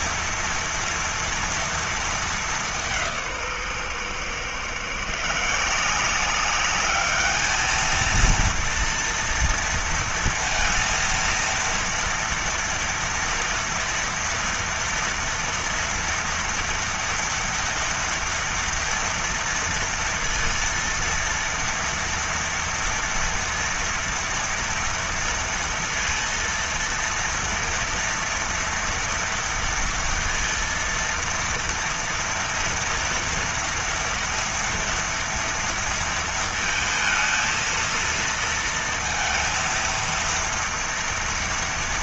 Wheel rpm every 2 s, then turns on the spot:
230, 180, 150, 210, 230, 230, 230, 230, 230, 230, 230, 230, 230, 230, 240, 230, 230, 230, 220, 230, 230.
none